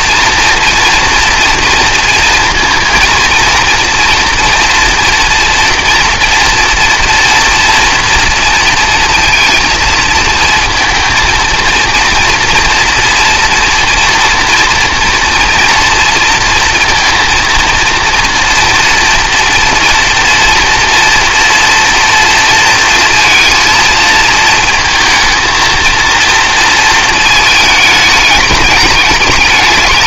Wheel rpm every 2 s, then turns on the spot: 230, 230, 230, 230, 230, 220, 230, 230, 230, 230, 230, 230, 230, 230, 210.
none